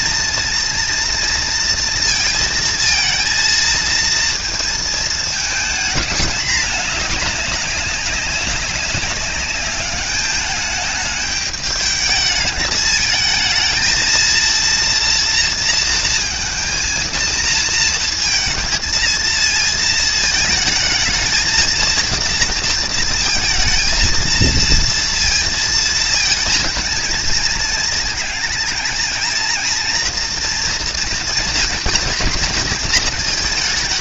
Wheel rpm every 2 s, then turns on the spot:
230, 230, 230, 210, 200, 210, 220, 230, 230, 230, 220, 230, 230, 230, 230, 240, 230.
none